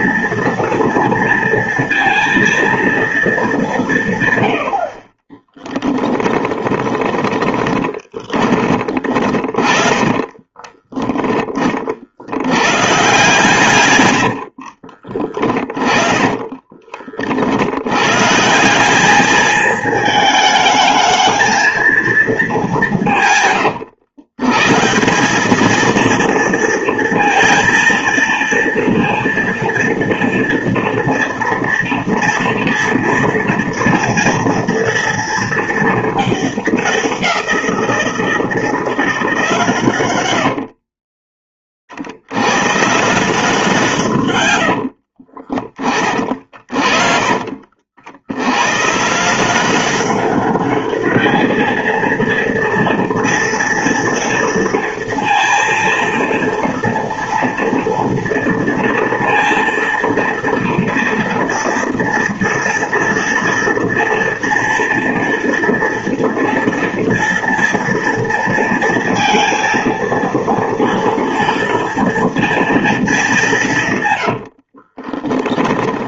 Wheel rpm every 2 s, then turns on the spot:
230, 220, 40, 20, 30, 20, 140, 40, 40, 200, 220, 170, 170, 230, 230, 230, 240, 230, 190, 170, 40, 150, 50, 50, 140, 210, 230, 230, 230, 230, 230, 230, 230, 230, 230, 230, 210, 30.
6-10 14-16 40-42 44-46 74-76